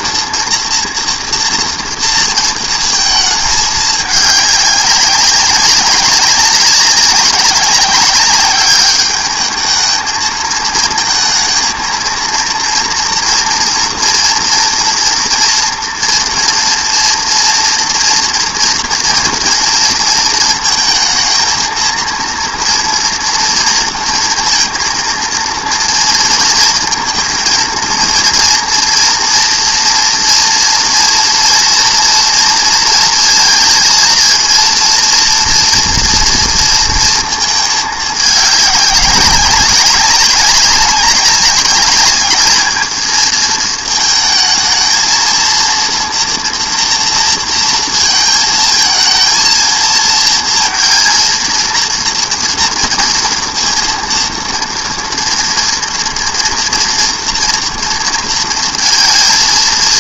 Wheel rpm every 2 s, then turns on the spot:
230, 220, 200, 200, 200, 220, 230, 230, 230, 240, 220, 230, 230, 230, 230, 230, 230, 230, 230, 200, 200, 210, 220, 230, 220, 230, 230, 230, 230, 230.
none